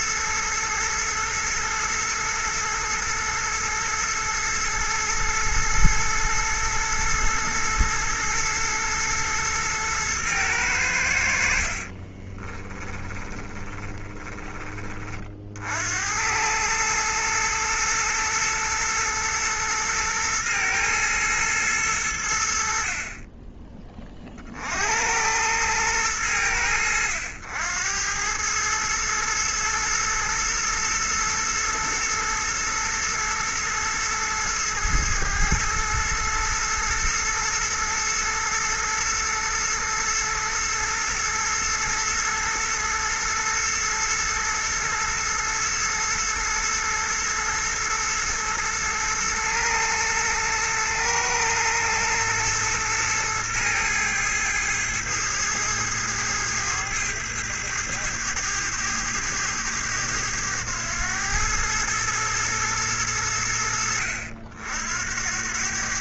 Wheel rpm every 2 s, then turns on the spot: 110, 110, 110, 110, 120, 110, 20, 20, 100, 120, 110, 60, 60, 90, 110, 110, 110, 110, 110, 110, 120, 110, 120, 110, 120, 120, 110, 110, 110, 100, 100, 110, 70.
12-14